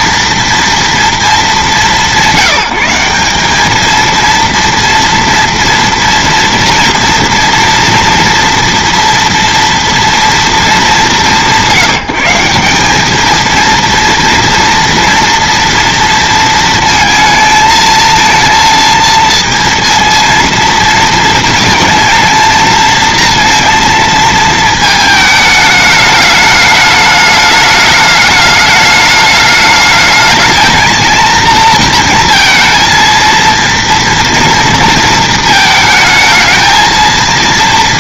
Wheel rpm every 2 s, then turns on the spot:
230, 190, 230, 230, 240, 230, 180, 230, 230, 230, 230, 230, 220, 210, 210, 220, 230, 230, 220.
none